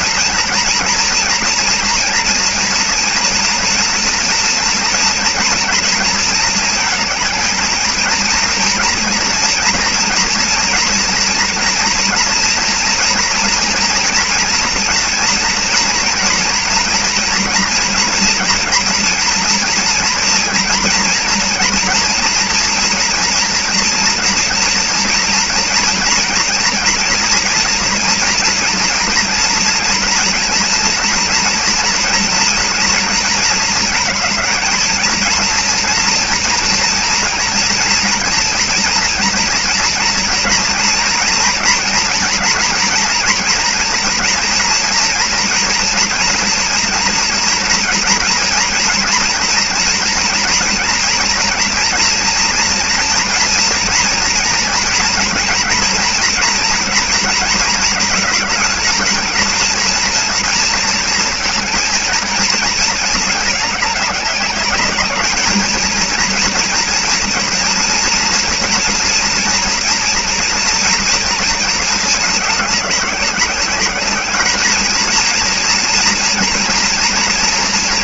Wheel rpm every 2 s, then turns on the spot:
240, 240, 230, 230, 230, 240, 230, 230, 230, 240, 230, 230, 230, 230, 230, 230, 230, 220, 230, 230, 230, 230, 230, 230, 230, 230, 240, 230, 230, 220, 230, 230, 200, 230, 230, 240, 210, 220, 240.
none